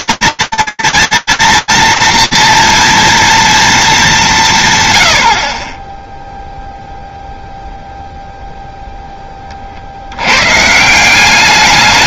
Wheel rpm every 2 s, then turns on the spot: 230, 230, 220, 30, 0, 70.
none